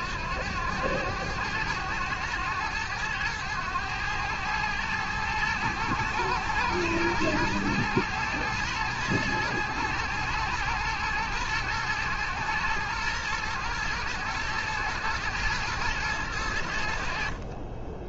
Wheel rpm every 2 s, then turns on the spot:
90, 100, 110, 110, 110, 110, 110, 110, 50.
none